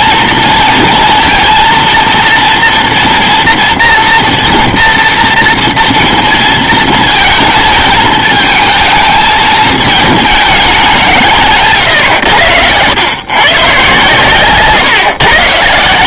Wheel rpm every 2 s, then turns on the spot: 230, 230, 230, 230, 220, 210, 90, 130.
none